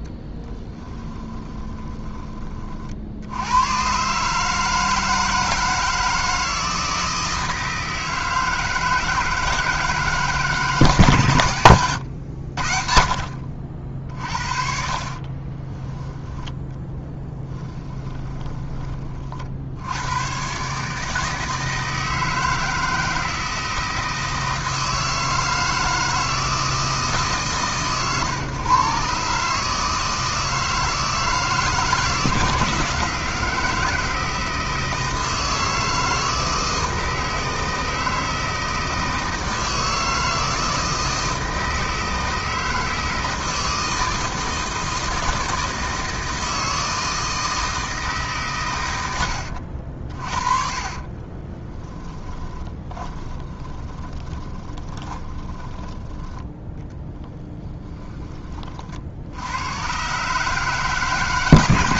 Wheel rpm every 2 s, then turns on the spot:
20, 40, 160, 160, 160, 140, 60, 50, 20, 30, 150, 160, 160, 150, 130, 160, 160, 160, 160, 160, 160, 160, 160, 160, 110, 40, 20, 20, 20, 60, 140.
0-2 14-18 50-58